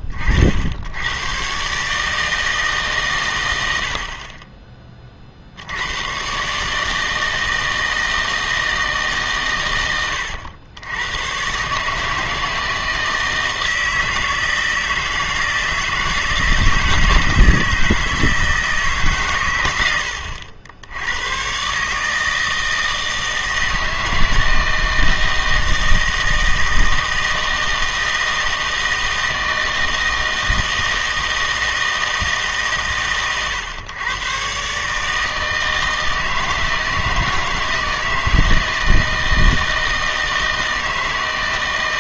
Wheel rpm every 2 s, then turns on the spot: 80, 140, 40, 150, 160, 90, 160, 160, 160, 160, 80, 160, 160, 160, 160, 160, 140, 140, 160, 160, 160.
none